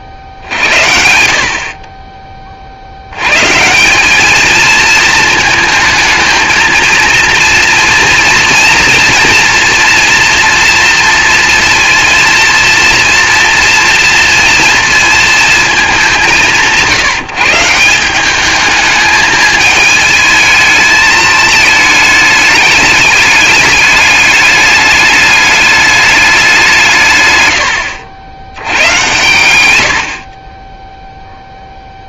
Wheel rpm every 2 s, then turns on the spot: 60, 50, 220, 220, 230, 240, 230, 230, 170, 210, 220, 210, 200, 180, 100, 20.
none